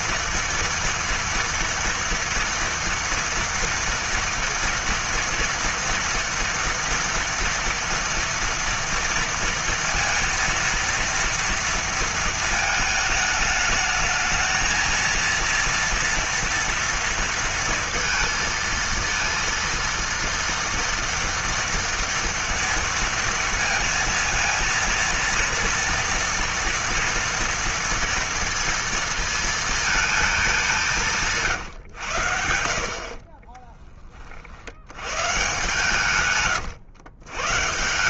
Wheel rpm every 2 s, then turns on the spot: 230, 230, 230, 230, 230, 230, 220, 220, 230, 230, 230, 230, 230, 230, 230, 190, 80, 70, 120.
none